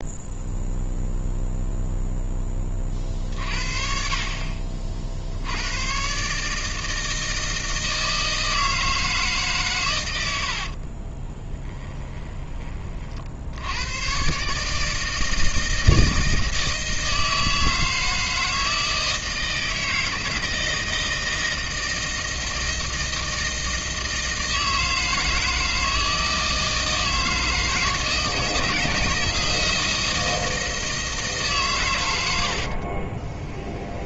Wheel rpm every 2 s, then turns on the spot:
0, 40, 50, 160, 160, 50, 40, 150, 160, 160, 160, 160, 160, 160, 160, 160, 40.
10-12 32-34